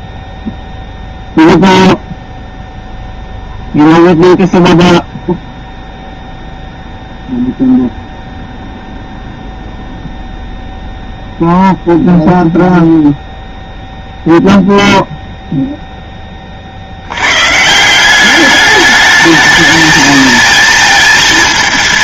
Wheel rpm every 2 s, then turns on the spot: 0, 0, 0, 0, 0, 0, 0, 0, 30, 200, 220.
none